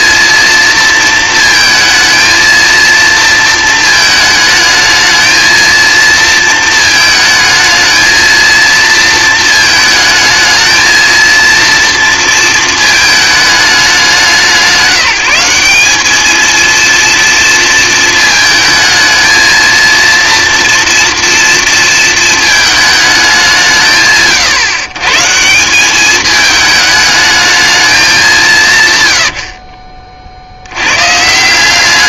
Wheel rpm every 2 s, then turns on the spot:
230, 230, 220, 230, 220, 220, 220, 180, 230, 220, 230, 220, 140, 220, 160, 80.
none